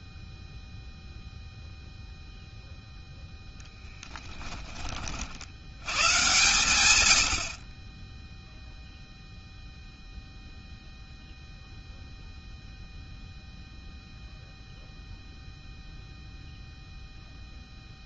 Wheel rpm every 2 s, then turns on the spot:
0, 0, 20, 120, 0, 0, 0, 0, 0.
none